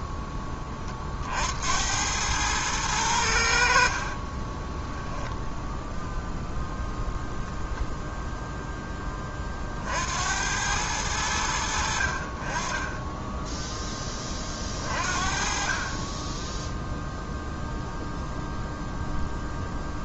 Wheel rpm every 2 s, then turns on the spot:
20, 110, 20, 0, 0, 90, 30, 30, 10, 0.
4-6